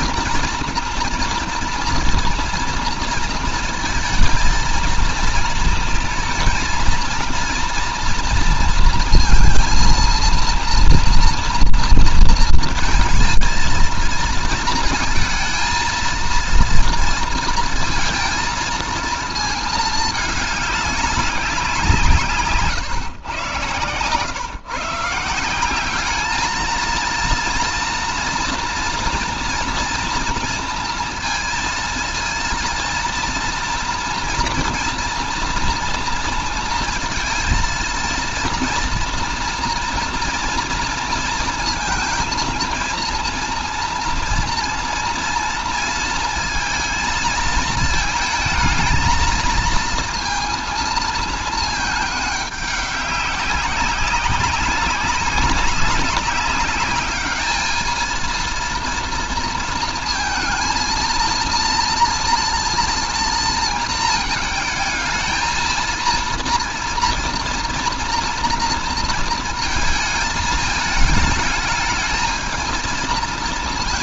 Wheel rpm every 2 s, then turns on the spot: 230, 230, 220, 230, 230, 230, 230, 230, 230, 230, 200, 150, 150, 230, 240, 230, 230, 230, 230, 230, 230, 230, 230, 220, 220, 230, 200, 190, 200, 230, 230, 230, 220, 230, 230, 220, 230.
none